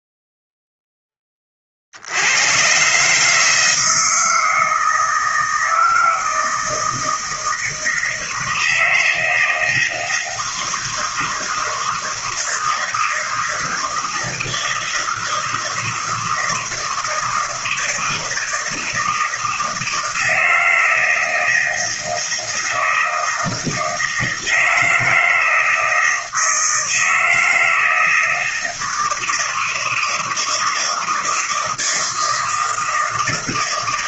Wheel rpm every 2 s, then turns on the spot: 0, 100, 160, 160, 160, 160, 160, 160, 160, 160, 160, 160, 160, 160, 160, 160, 160.
none